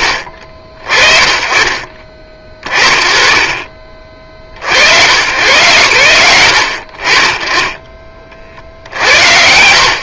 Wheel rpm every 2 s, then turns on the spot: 50, 40, 110, 50, 40.
none